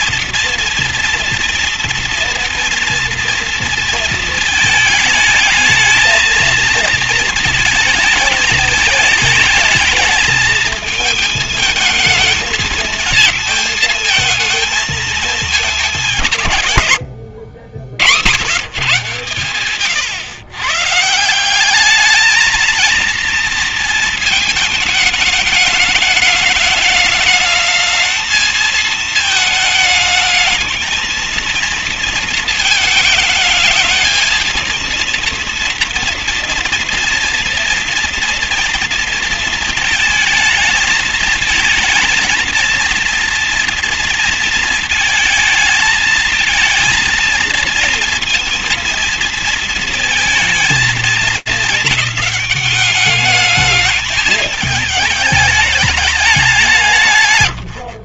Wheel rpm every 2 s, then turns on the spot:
230, 230, 230, 230, 210, 220, 230, 220, 150, 120, 120, 220, 220, 210, 220, 220, 230, 220, 230, 230, 220, 220, 230, 230, 230, 220, 210, 220, 190.
none